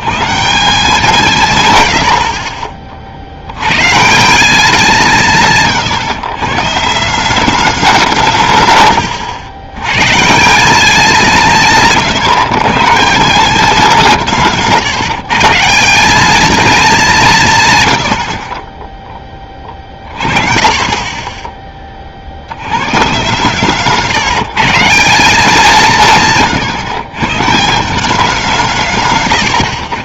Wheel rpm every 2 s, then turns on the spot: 180, 40, 180, 140, 120, 190, 140, 150, 220, 30, 40, 110, 170, 130, 160.
none